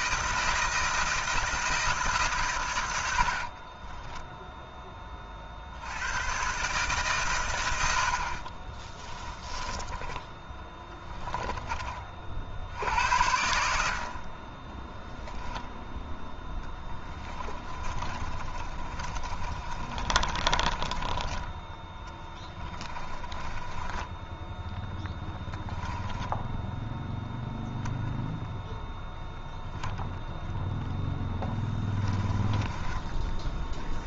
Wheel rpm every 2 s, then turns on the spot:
160, 100, 20, 130, 20, 20, 70, 10, 10, 30, 20, 20, 10, 0, 0, 0, 10.
8-12 16-26 32-34